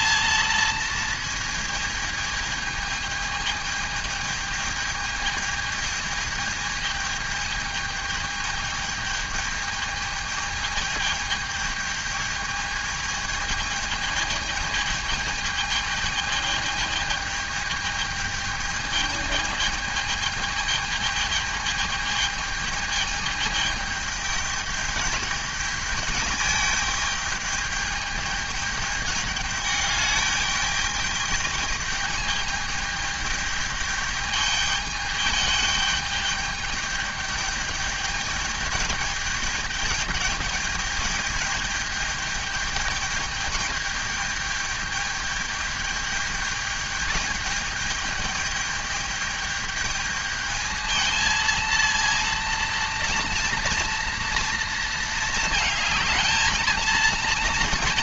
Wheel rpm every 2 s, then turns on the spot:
220, 220, 220, 220, 220, 220, 210, 220, 210, 220, 220, 220, 210, 210, 210, 210, 210, 210, 210, 210, 210, 210, 210, 210, 210, 220, 230, 220, 220.
none